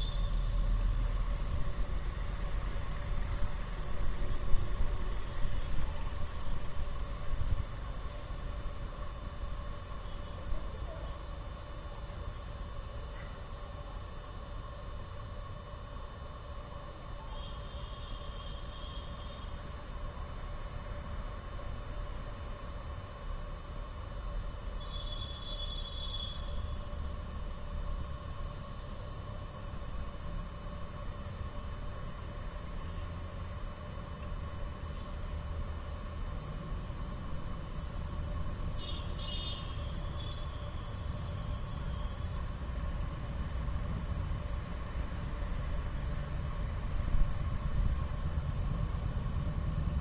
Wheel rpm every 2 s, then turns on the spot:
0, 0, 0, 0, 0, 0, 0, 0, 0, 0, 0, 0, 0, 0, 0, 0, 0, 0, 0, 0, 0, 0, 0, 0, 0.
none